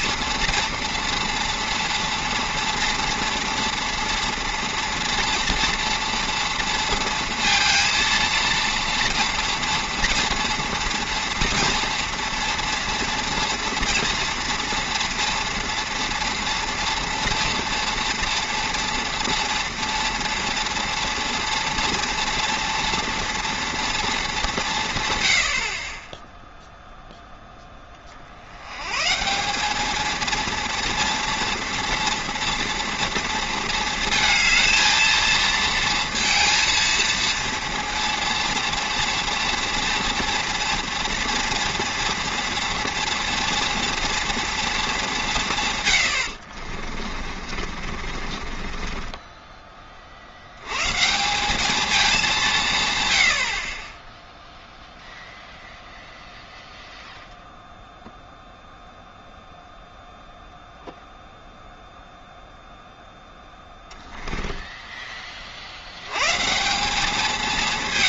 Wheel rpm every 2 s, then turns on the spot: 230, 230, 230, 230, 230, 230, 230, 230, 230, 230, 230, 230, 180, 0, 90, 230, 230, 230, 230, 230, 230, 230, 230, 50, 30, 100, 170, 0, 0, 0, 0, 0, 10, 160.
46-50 64-66